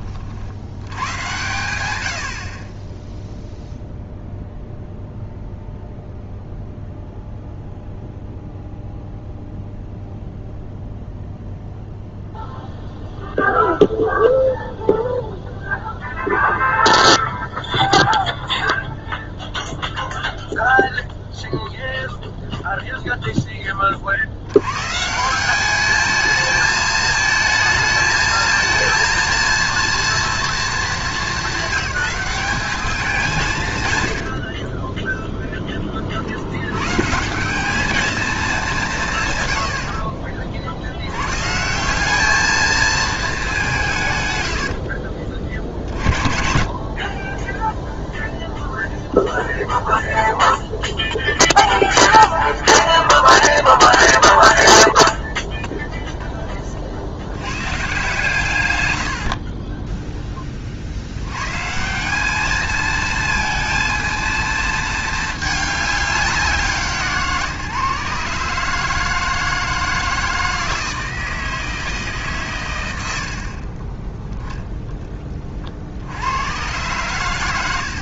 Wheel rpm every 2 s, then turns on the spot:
100, 10, 0, 0, 0, 0, 0, 0, 0, 0, 0, 0, 150, 220, 230, 210, 200, 20, 120, 160, 90, 220, 60, 40, 0, 0, 0, 0, 60, 100, 60, 220, 220, 150, 150, 160, 100, 10, 110.
34-36 44-48